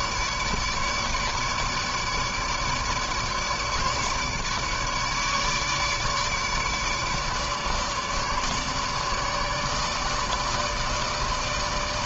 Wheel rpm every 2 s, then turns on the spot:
150, 150, 150, 150, 150, 150.
none